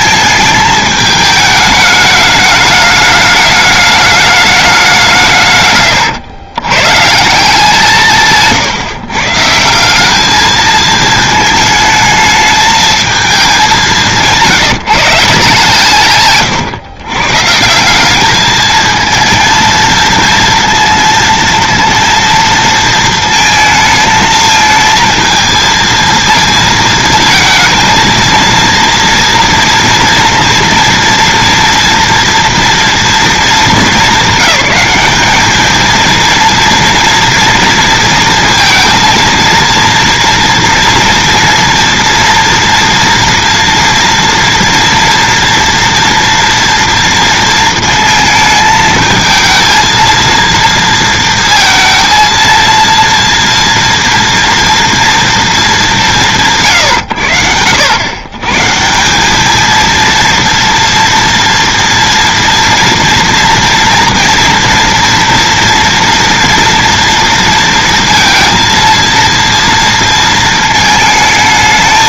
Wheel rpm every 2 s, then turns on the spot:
220, 210, 200, 120, 140, 220, 220, 160, 130, 220, 230, 230, 220, 230, 230, 240, 240, 200, 230, 230, 230, 240, 230, 230, 220, 230, 230, 230, 150, 140, 230, 230, 230, 230, 230, 220.
none